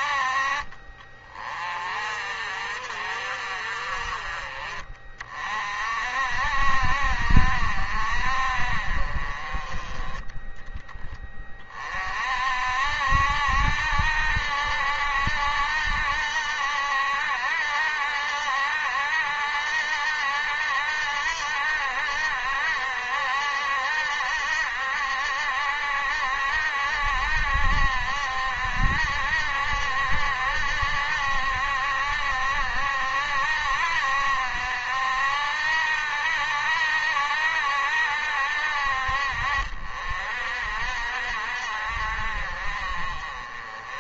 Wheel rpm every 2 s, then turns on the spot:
40, 50, 40, 50, 50, 10, 50, 70, 70, 70, 70, 70, 70, 70, 60, 70, 60, 60, 70, 60, 60, 50.
none